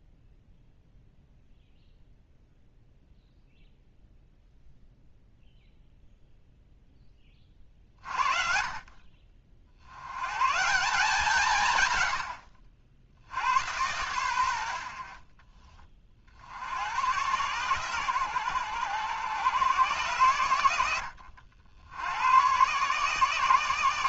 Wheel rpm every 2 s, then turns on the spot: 0, 0, 0, 0, 40, 160, 60, 80, 80, 110, 100, 130.
none